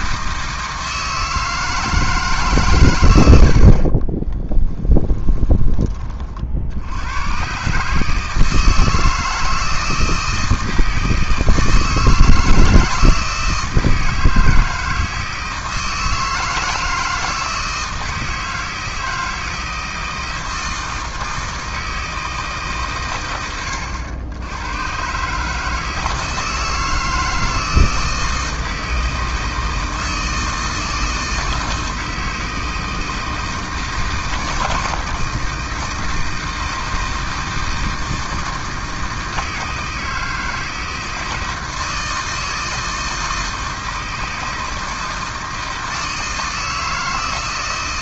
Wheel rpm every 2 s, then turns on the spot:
160, 120, 10, 80, 160, 160, 160, 160, 160, 160, 160, 140, 100, 160, 160, 160, 160, 160, 160, 160, 160, 160, 160, 160.
4-6